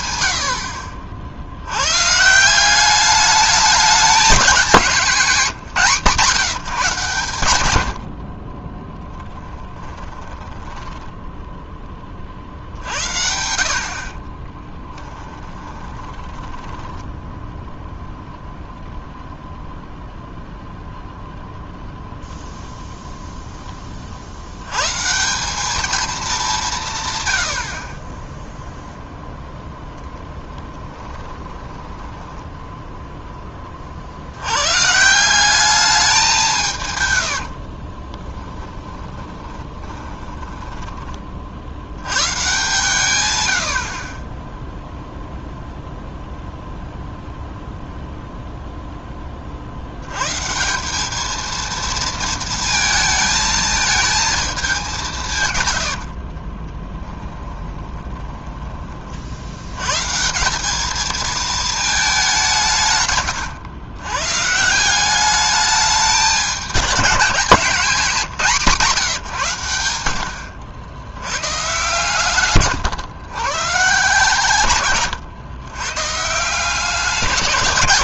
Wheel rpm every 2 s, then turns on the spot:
60, 190, 210, 150, 20, 10, 60, 20, 10, 0, 0, 0, 110, 190, 0, 30, 10, 120, 150, 20, 10, 130, 0, 0, 0, 170, 230, 200, 20, 20, 200, 160, 160, 210, 170, 90, 120, 130, 170.
8-12 14-18 30-34 38-42 56-58